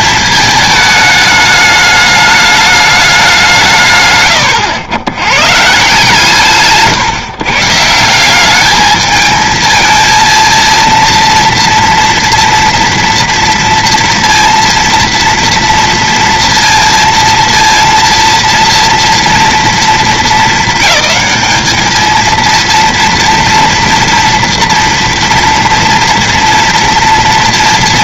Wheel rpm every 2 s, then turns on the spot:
220, 210, 100, 140, 200, 230, 230, 230, 230, 230, 220, 230, 230, 230.
none